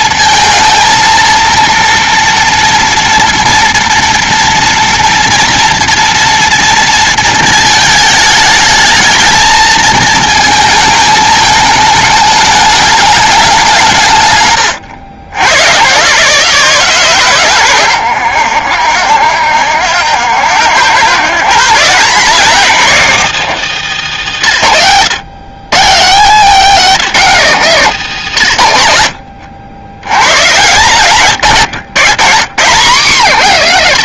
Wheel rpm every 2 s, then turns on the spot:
230, 240, 230, 230, 210, 220, 210, 130, 150, 70, 90, 180, 140, 220, 120, 140, 170.
none